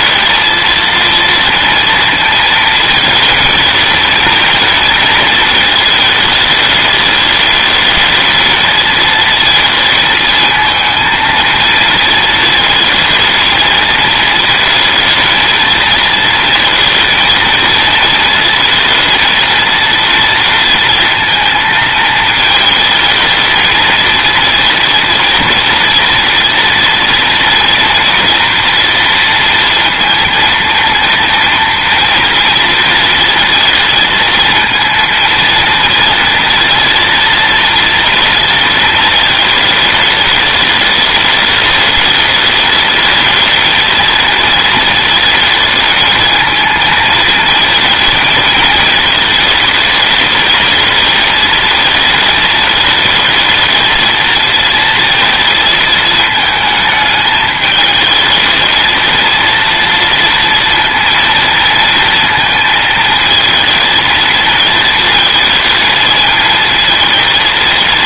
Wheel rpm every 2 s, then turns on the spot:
230, 220, 230, 210, 220, 220, 220, 220, 230, 220, 230, 220, 230, 230, 230, 230, 230, 230, 230, 230, 210, 210, 220, 220, 220, 220, 220, 230, 220, 220, 230, 220, 220, 230.
none